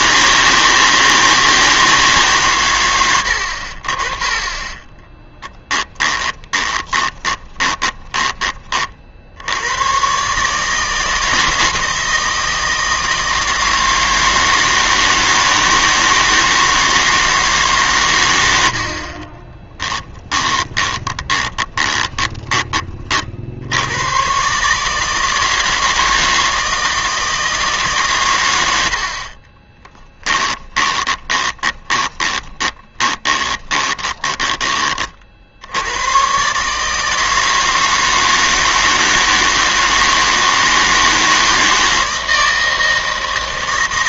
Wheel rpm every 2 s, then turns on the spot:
160, 120, 20, 20, 30, 150, 160, 160, 160, 70, 20, 20, 140, 160, 100, 20, 20, 20, 150, 160, 160, 160.
4-8 20-22 30-34